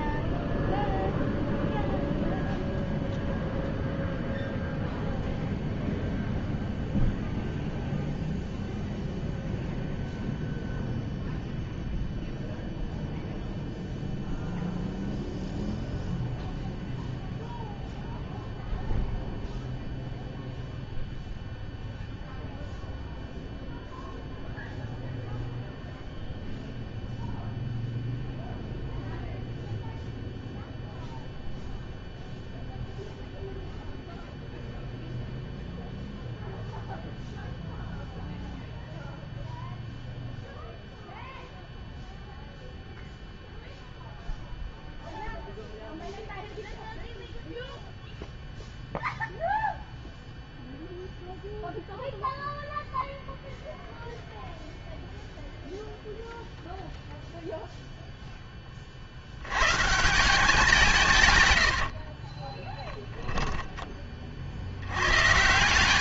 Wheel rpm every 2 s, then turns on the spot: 0, 0, 0, 0, 0, 0, 0, 0, 0, 0, 0, 0, 0, 0, 0, 0, 0, 0, 0, 0, 0, 0, 0, 0, 0, 0, 0, 0, 0, 20, 170, 10, 80.
62-64